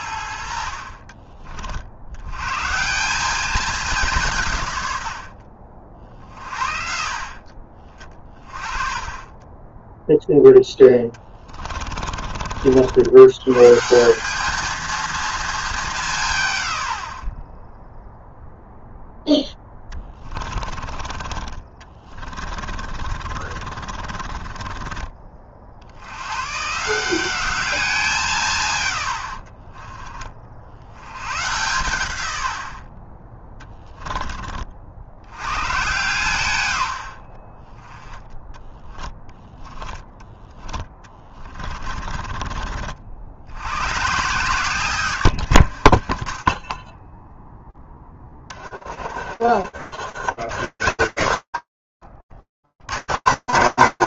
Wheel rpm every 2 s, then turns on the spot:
50, 140, 130, 50, 40, 10, 60, 220, 120, 0, 30, 30, 30, 140, 140, 60, 80, 40, 110, 10, 20, 30, 130, 20, 40, 110, 140.
10-12 20-26 40-42